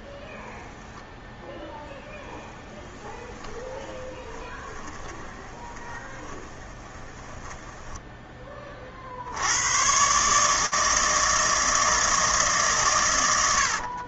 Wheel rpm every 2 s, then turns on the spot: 0, 20, 20, 20, 80, 160, 100.
2-8 12-14